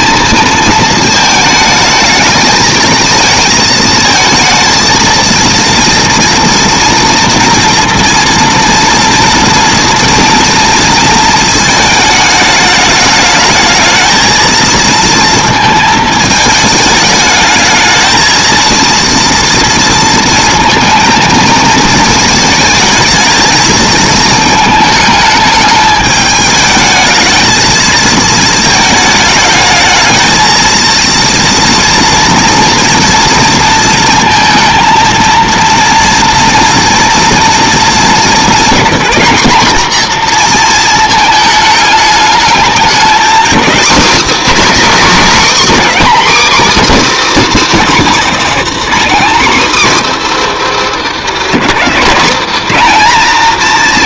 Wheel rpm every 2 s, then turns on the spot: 220, 220, 220, 230, 230, 230, 210, 230, 210, 230, 230, 220, 220, 220, 220, 230, 230, 230, 230, 210, 230, 220, 300, 310, 270, 290, 240.
none